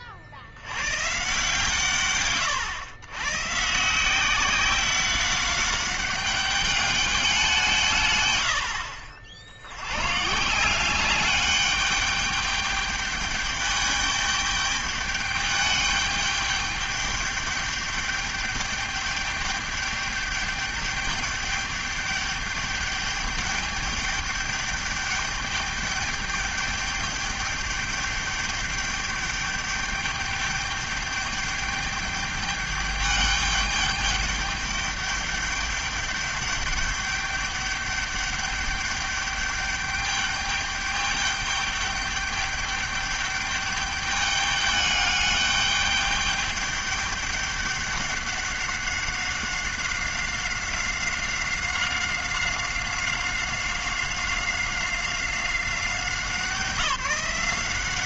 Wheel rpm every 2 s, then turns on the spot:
70, 130, 180, 200, 90, 160, 210, 210, 210, 210, 210, 210, 210, 210, 210, 210, 210, 210, 210, 200, 200, 210, 210, 200, 200, 190, 190, 190, 180.
none